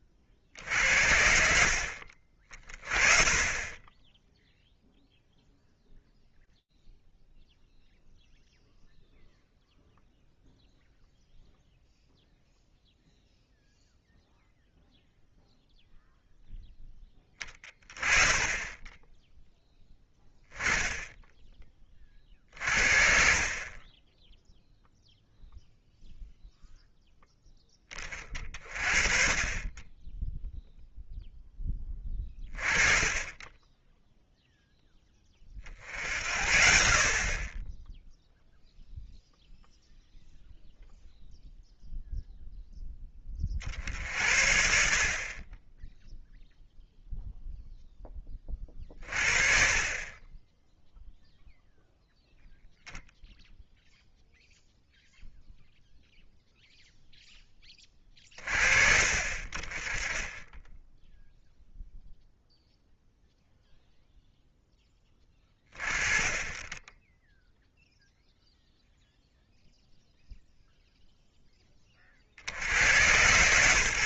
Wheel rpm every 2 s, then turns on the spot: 40, 50, 10, 0, 0, 0, 0, 0, 0, 20, 10, 40, 0, 0, 30, 10, 20, 0, 70, 0, 0, 0, 60, 0, 30, 20, 0, 0, 0, 40, 10, 0, 0, 20, 0, 0, 90.
none